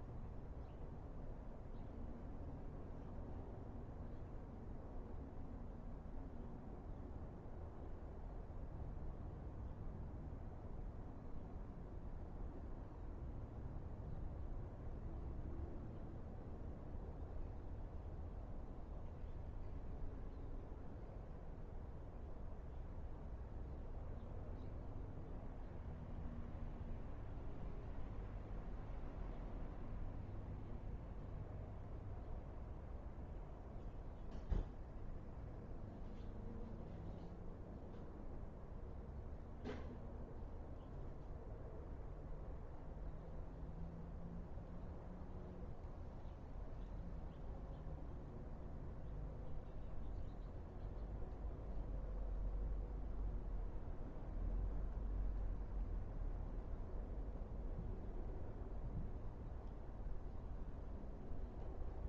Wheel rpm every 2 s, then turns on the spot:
0, 0, 0, 0, 0, 0, 0, 0, 0, 0, 0, 0, 0, 0, 0, 0, 0, 0, 0, 0, 0, 0, 0, 0, 0, 0, 0, 0, 0, 0, 0.
none